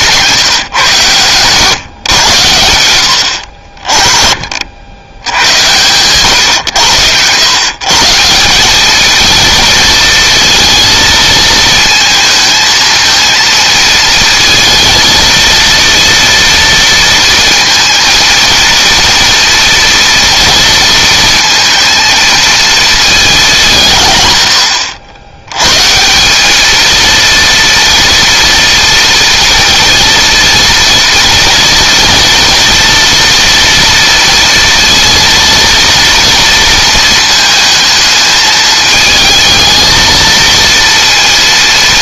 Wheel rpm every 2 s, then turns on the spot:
150, 90, 70, 110, 200, 230, 220, 230, 230, 230, 230, 220, 80, 210, 230, 230, 230, 230, 230, 220, 230.
none